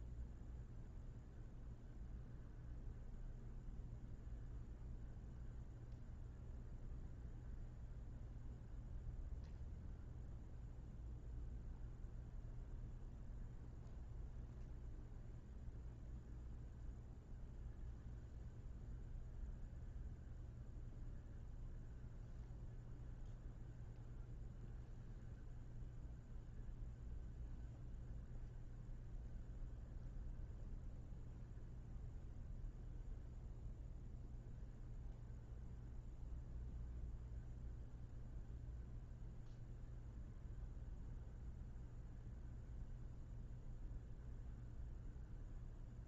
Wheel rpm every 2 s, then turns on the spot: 0, 0, 0, 0, 0, 0, 0, 0, 0, 0, 0, 0, 0, 0, 0, 0, 0, 0, 0, 0, 0, 0, 0.
none